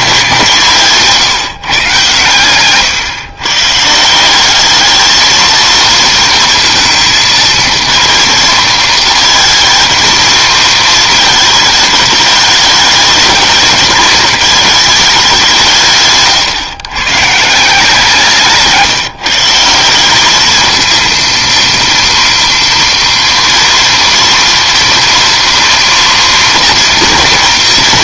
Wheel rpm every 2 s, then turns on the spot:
160, 130, 210, 230, 220, 230, 210, 210, 130, 160, 220, 230, 230, 240.
2-4 18-20